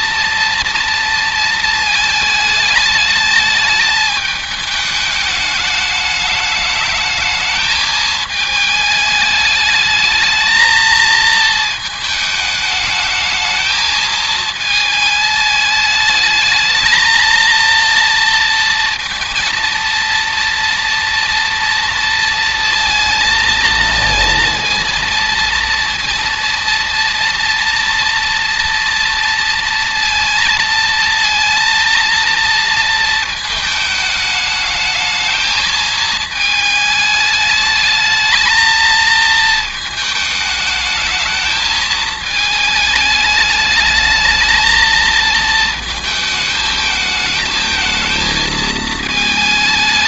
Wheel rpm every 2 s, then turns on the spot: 230, 210, 210, 210, 210, 220, 220, 220, 220, 230, 240, 230, 230, 230, 230, 230, 230, 220, 220, 220, 220, 220, 220, 220, 220.
none